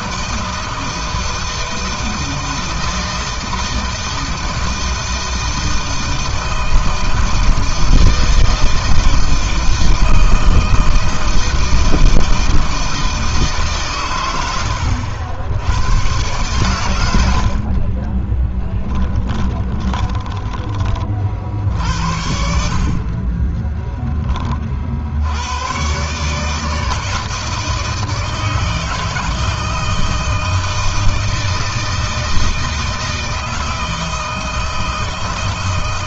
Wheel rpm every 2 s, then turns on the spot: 160, 160, 160, 160, 160, 160, 160, 110, 120, 20, 20, 70, 20, 140, 160, 160, 160, 160.
18-20